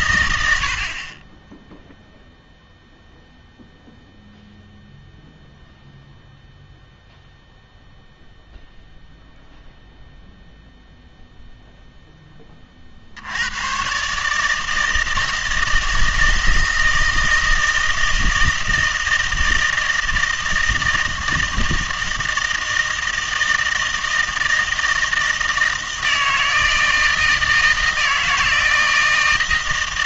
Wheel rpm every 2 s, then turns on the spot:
60, 0, 0, 0, 0, 0, 30, 160, 160, 160, 160, 160, 160, 160, 160.
none